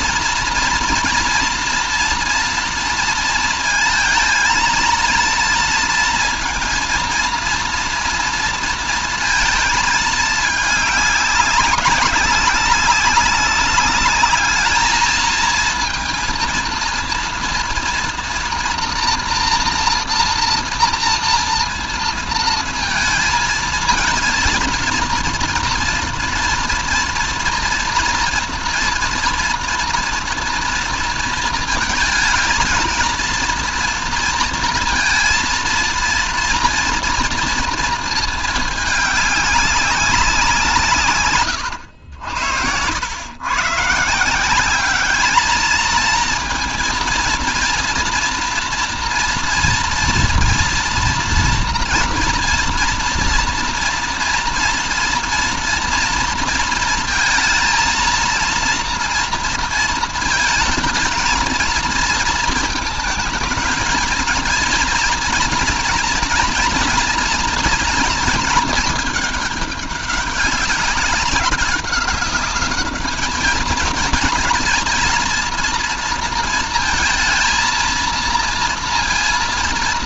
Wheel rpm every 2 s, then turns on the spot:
230, 230, 230, 230, 230, 200, 190, 220, 230, 240, 230, 230, 240, 240, 230, 230, 220, 230, 230, 210, 140, 90, 200, 230, 230, 240, 240, 230, 220, 230, 220, 210, 230, 230, 210, 190, 200, 220, 230, 230.
none